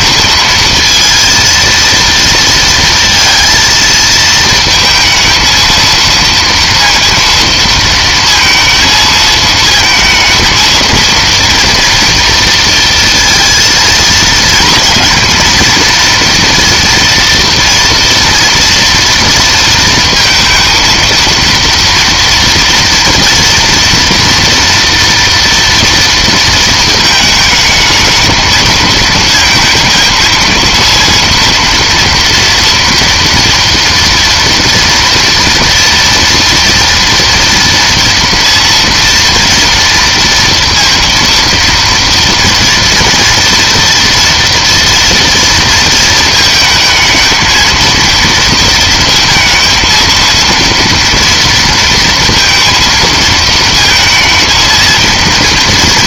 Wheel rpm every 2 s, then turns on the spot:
230, 230, 220, 230, 220, 230, 230, 230, 230, 230, 230, 230, 230, 220, 220, 230, 230, 230, 230, 230, 230, 240, 230, 220, 230, 230, 230, 230.
none